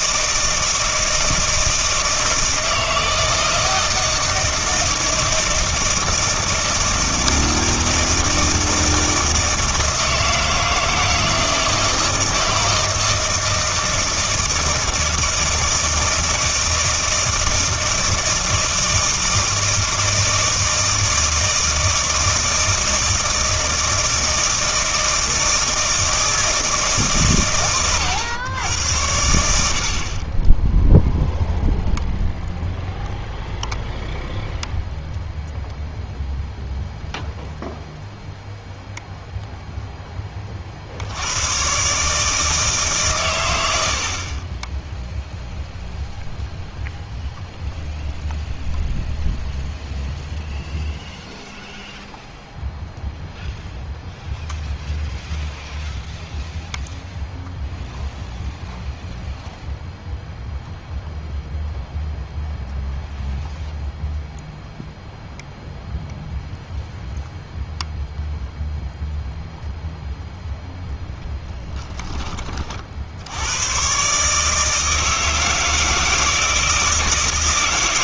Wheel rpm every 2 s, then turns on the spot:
160, 160, 160, 160, 160, 160, 160, 160, 160, 160, 160, 160, 160, 160, 100, 10, 0, 0, 0, 0, 50, 150, 20, 0, 0, 0, 0, 0, 0, 0, 0, 0, 0, 0, 0, 0, 40, 160, 160.
none